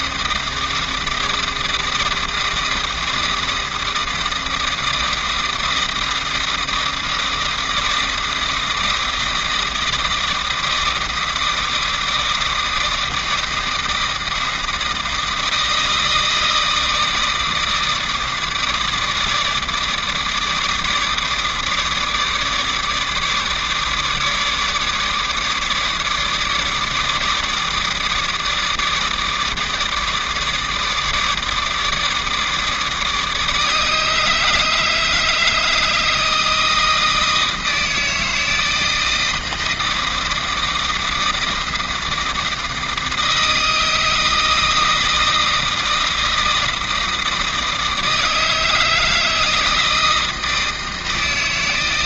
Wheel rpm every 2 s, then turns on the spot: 160, 160, 160, 160, 160, 160, 160, 160, 160, 160, 150, 150, 150, 150, 160, 160, 160, 150, 160, 160, 160, 160, 160, 160, 160, 160.
none